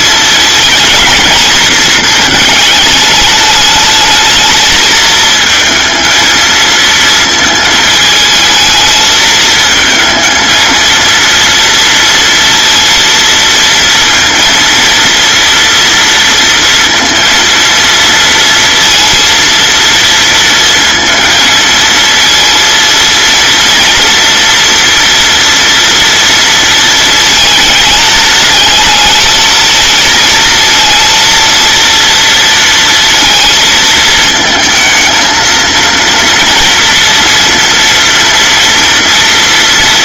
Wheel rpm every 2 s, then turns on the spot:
220, 210, 220, 230, 220, 230, 230, 230, 230, 230, 230, 230, 240, 220, 220, 230, 230, 220, 230, 230.
none